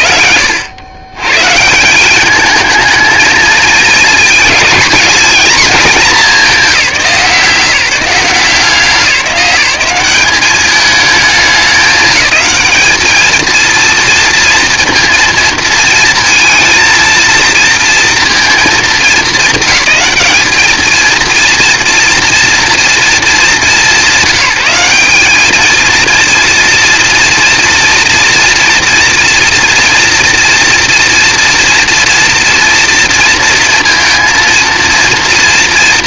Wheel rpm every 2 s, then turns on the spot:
110, 220, 220, 180, 190, 210, 220, 230, 230, 200, 230, 220, 200, 230, 240, 230, 230, 230.
none